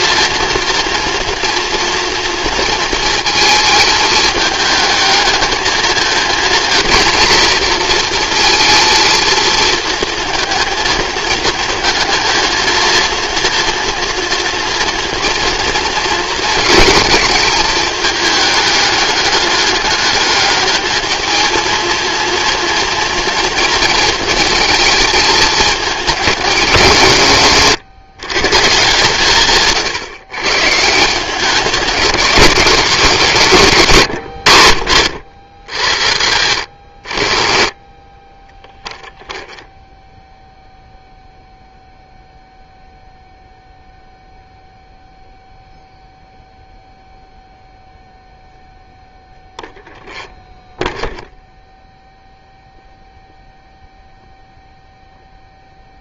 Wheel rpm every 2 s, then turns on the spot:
230, 230, 220, 230, 230, 220, 220, 230, 220, 210, 210, 230, 220, 180, 150, 160, 180, 80, 60, 10, 0, 0, 0, 0, 0, 0, 0, 0.
none